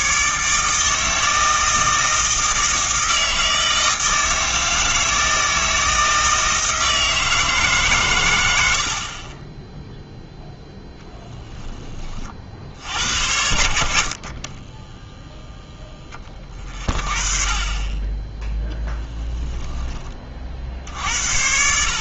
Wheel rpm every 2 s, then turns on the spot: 160, 160, 160, 160, 70, 0, 60, 10, 40, 10, 60.
14-16 18-20